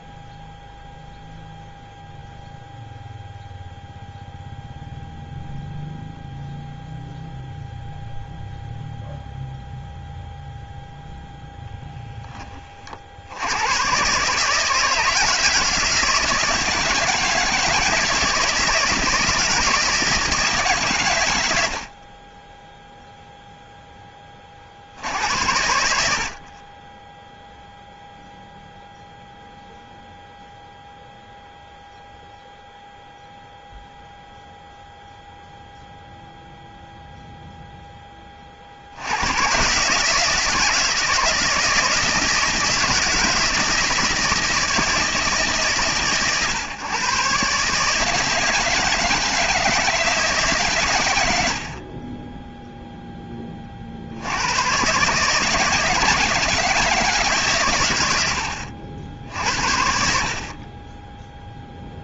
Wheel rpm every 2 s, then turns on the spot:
0, 0, 0, 0, 0, 0, 40, 160, 160, 160, 140, 0, 60, 20, 0, 0, 0, 0, 0, 70, 170, 160, 160, 130, 160, 120, 0, 120, 160, 70, 20.
none